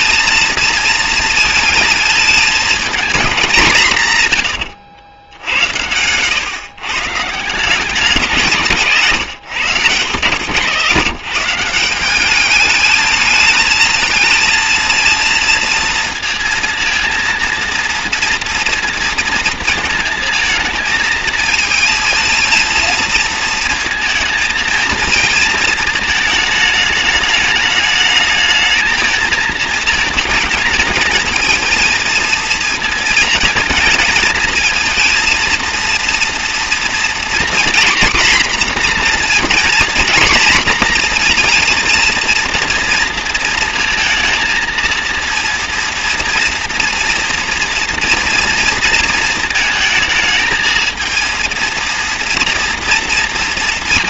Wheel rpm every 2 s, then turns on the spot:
220, 220, 100, 130, 140, 150, 210, 230, 230, 230, 220, 230, 230, 210, 220, 220, 220, 230, 240, 240, 240, 230, 230, 230, 230, 220, 230.
8-10